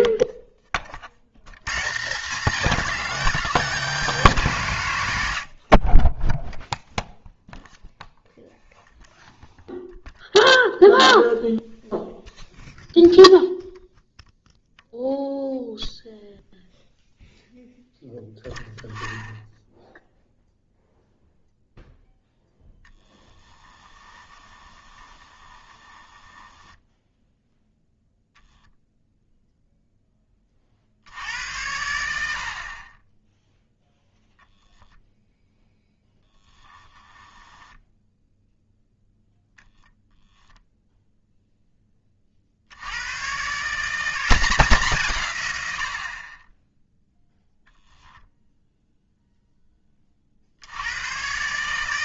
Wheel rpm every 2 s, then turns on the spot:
30, 220, 120, 0, 0, 0, 0, 0, 0, 10, 0, 0, 20, 10, 10, 50, 40, 10, 10, 0, 0, 60, 170, 10, 0, 70.
24-28